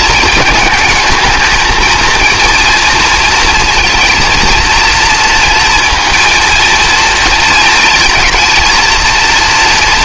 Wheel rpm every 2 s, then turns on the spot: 220, 240, 230, 230, 220.
none